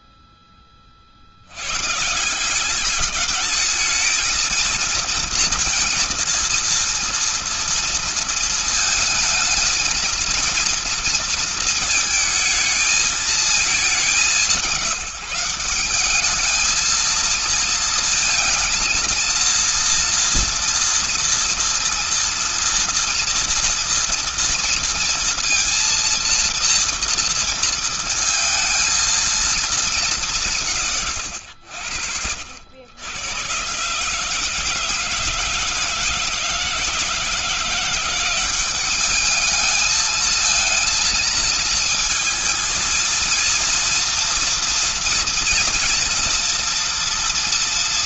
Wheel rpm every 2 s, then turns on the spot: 20, 170, 220, 230, 230, 230, 220, 190, 210, 230, 230, 230, 230, 230, 230, 170, 80, 160, 160, 190, 220, 230, 230, 230.
none